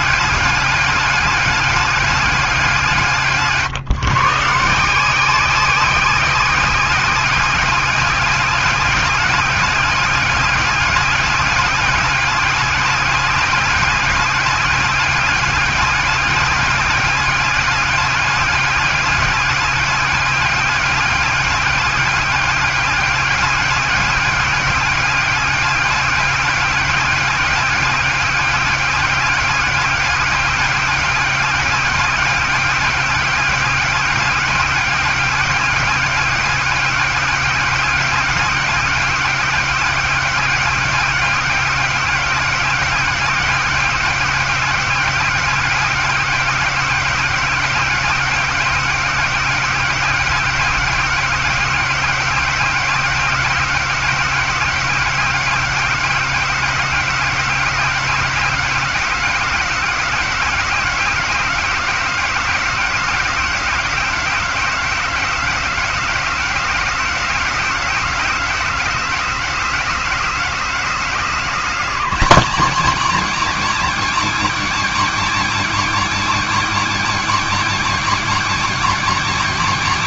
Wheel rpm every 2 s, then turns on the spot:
200, 170, 170, 190, 200, 190, 200, 200, 200, 200, 200, 200, 200, 200, 200, 200, 200, 200, 200, 200, 190, 190, 200, 190, 190, 190, 190, 190, 190, 190, 190, 190, 190, 180, 180, 180, 260, 260, 260, 260.
none